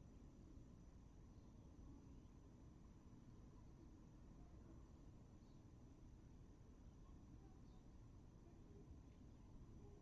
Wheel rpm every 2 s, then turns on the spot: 0, 0, 0, 0, 0.
none